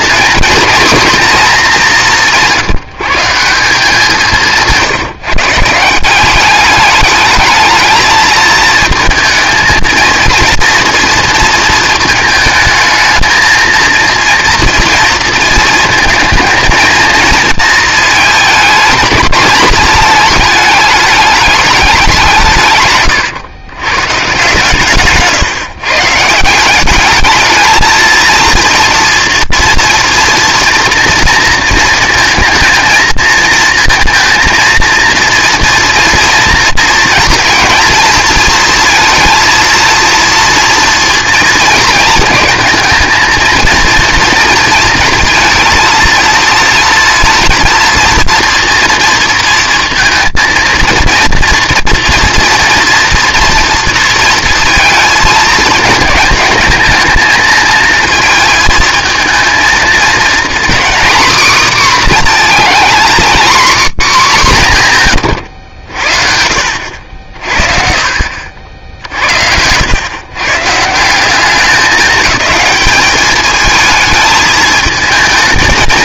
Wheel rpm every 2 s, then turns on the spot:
230, 170, 160, 200, 220, 240, 220, 230, 220, 210, 220, 140, 150, 180, 230, 230, 230, 230, 230, 230, 230, 230, 230, 230, 230, 230, 230, 230, 220, 220, 250, 240, 190, 60, 50, 120, 210, 220.
none